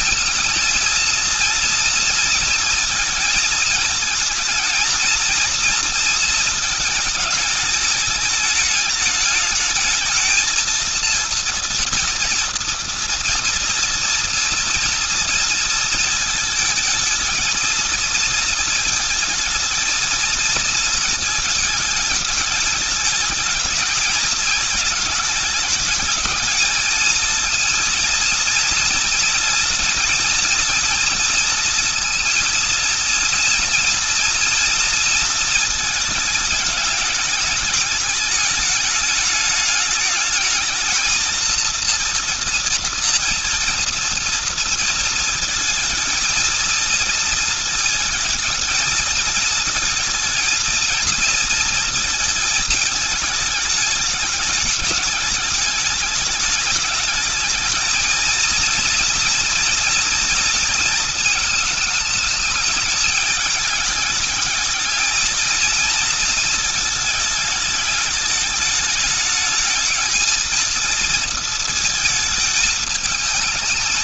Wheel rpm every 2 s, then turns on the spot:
230, 220, 230, 210, 220, 230, 230, 230, 230, 220, 230, 210, 220, 220, 240, 230, 230, 230, 210, 220, 230, 230, 230, 230, 220, 230, 220, 210, 210, 230, 230, 220, 220, 220, 210, 230, 220.
none